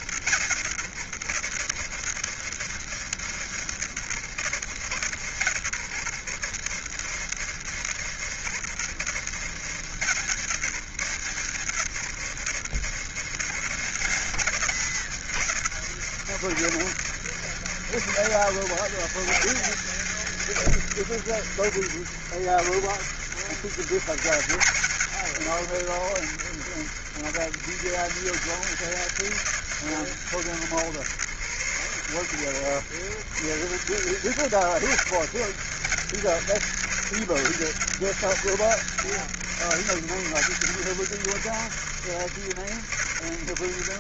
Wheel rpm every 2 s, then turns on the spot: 80, 80, 70, 80, 80, 80, 90, 90, 90, 100, 70, 80, 70, 70, 90, 70, 80, 80, 90, 90, 80, 70.
none